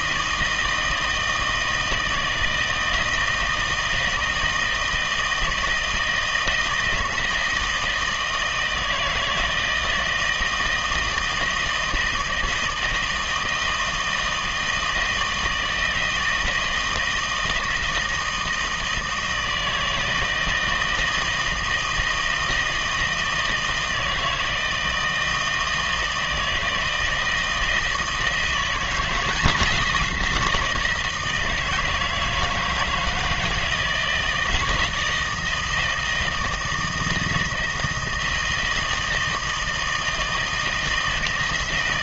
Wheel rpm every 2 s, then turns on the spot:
160, 160, 160, 160, 160, 160, 160, 160, 160, 160, 160, 160, 160, 160, 170, 170, 160, 160, 160, 160, 160.
none